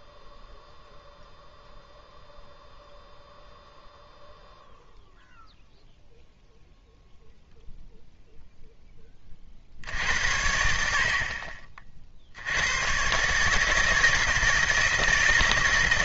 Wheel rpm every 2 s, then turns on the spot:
0, 0, 0, 0, 10, 80, 110, 160.
none